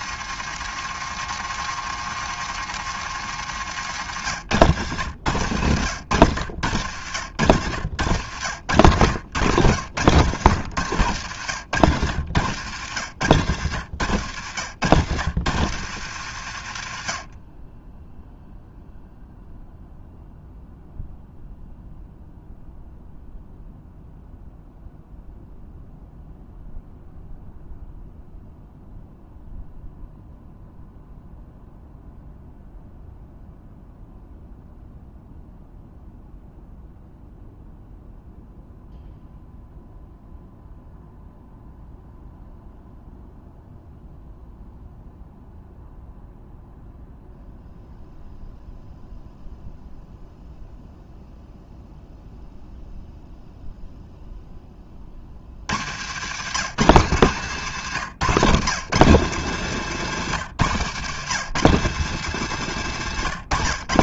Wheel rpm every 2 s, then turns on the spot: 130, 120, 100, 90, 110, 100, 80, 100, 50, 0, 0, 0, 0, 0, 0, 0, 0, 0, 0, 0, 0, 0, 0, 0, 0, 0, 0, 30, 160, 160, 140, 140.
4-10 12-14